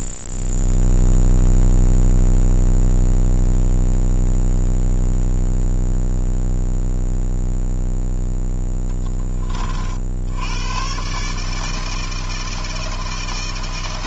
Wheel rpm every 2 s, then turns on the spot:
0, 0, 0, 0, 10, 100, 160.
none